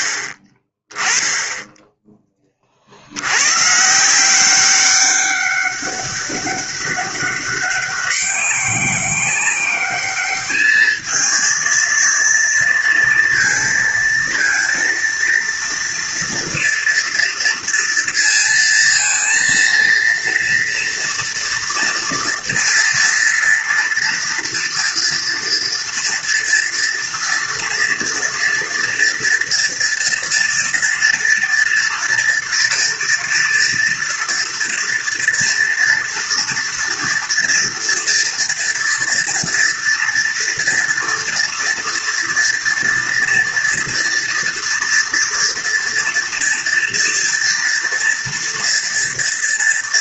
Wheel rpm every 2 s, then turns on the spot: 20, 60, 200, 200, 200, 210, 230, 230, 230, 230, 230, 230, 230, 230, 230, 230, 230, 240, 240, 240, 230, 230, 230, 230, 230.
none